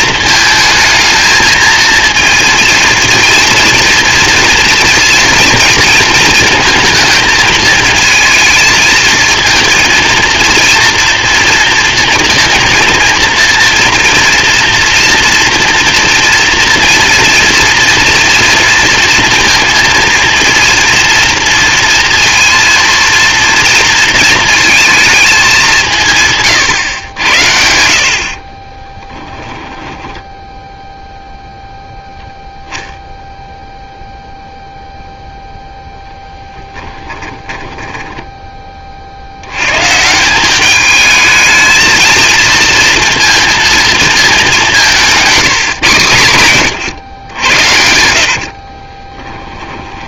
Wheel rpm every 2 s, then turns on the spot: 220, 230, 230, 230, 230, 240, 230, 230, 230, 230, 240, 230, 230, 130, 20, 0, 0, 0, 20, 90, 220, 230, 160, 80, 10.
26-30 36-38 44-46 48-50